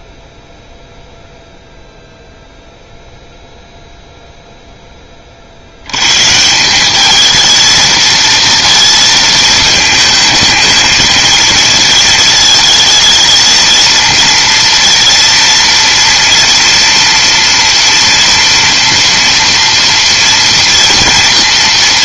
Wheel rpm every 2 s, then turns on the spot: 0, 0, 0, 170, 230, 220, 220, 230, 230, 230, 230.
none